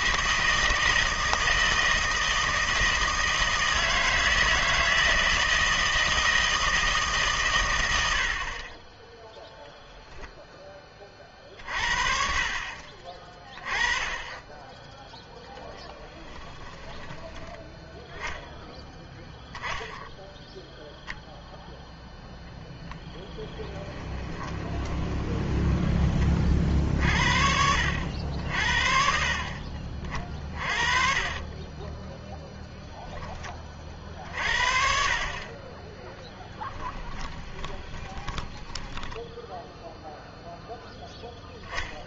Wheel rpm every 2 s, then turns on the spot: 160, 160, 160, 160, 30, 10, 30, 10, 10, 10, 0, 0, 20, 50, 60, 40, 0, 50, 10, 10, 0.
16-18 24-26 36-40